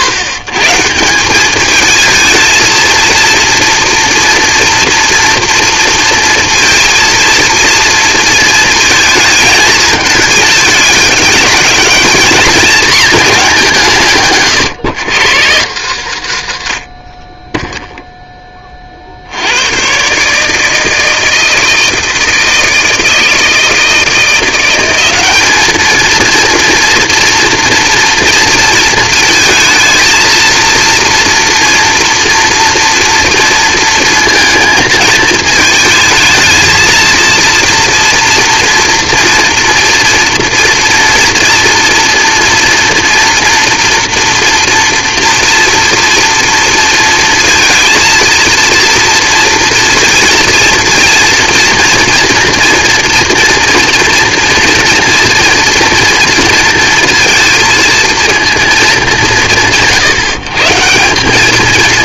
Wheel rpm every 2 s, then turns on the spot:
150, 220, 230, 230, 230, 210, 220, 140, 80, 20, 160, 160, 180, 230, 220, 230, 240, 230, 220, 230, 230, 230, 230, 230, 230, 230, 240, 230, 230, 220, 170.
none